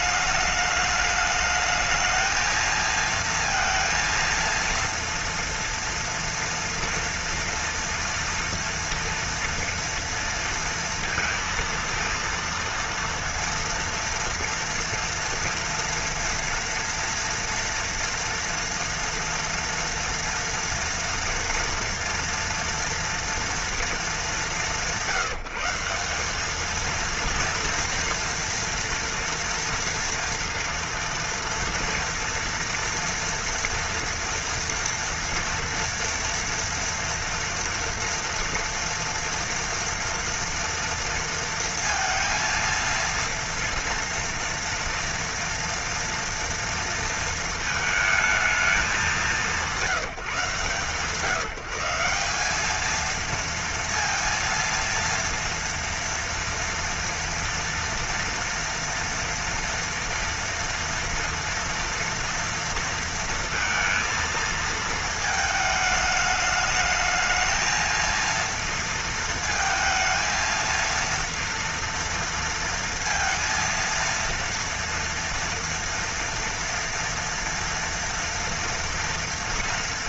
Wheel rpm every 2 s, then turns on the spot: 210, 220, 230, 240, 240, 230, 230, 230, 240, 230, 230, 230, 170, 210, 230, 230, 230, 240, 230, 230, 230, 230, 230, 230, 200, 150, 210, 230, 230, 230, 230, 230, 230, 210, 230, 230, 230, 230, 230, 230.
none